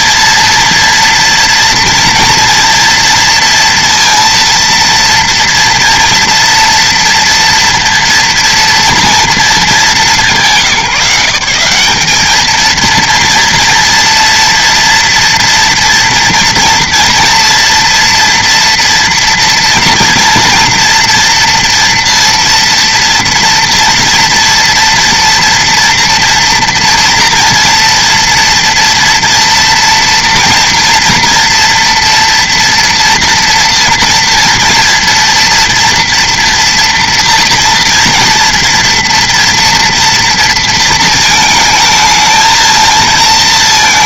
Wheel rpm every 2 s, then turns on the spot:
230, 230, 230, 230, 230, 160, 230, 230, 230, 230, 240, 230, 230, 230, 230, 230, 240, 230, 240, 240, 230, 220.
none